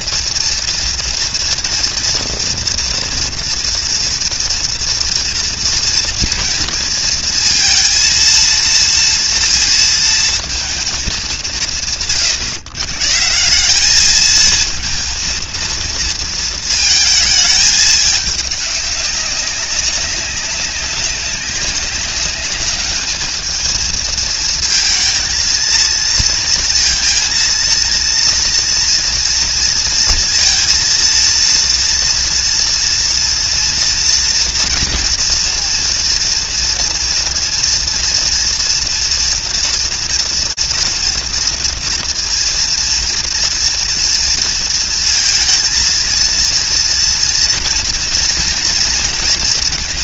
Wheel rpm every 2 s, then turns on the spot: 230, 230, 230, 230, 230, 180, 140, 230, 220, 200, 200, 210, 230, 230, 230, 230, 230, 230, 230, 240, 240, 230, 230, 230, 230.
none